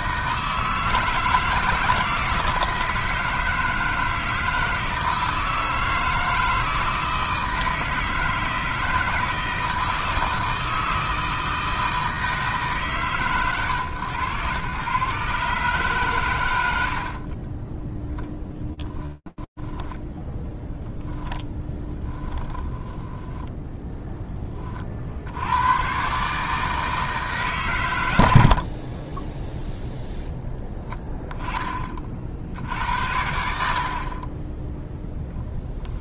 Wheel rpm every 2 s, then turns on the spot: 160, 160, 160, 160, 160, 160, 140, 130, 70, 10, 10, 0, 80, 140, 10, 20, 60, 0.
18-22